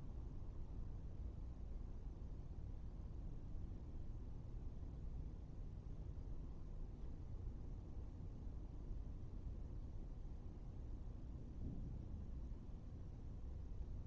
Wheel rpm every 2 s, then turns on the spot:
0, 0, 0, 0, 0, 0, 0.
none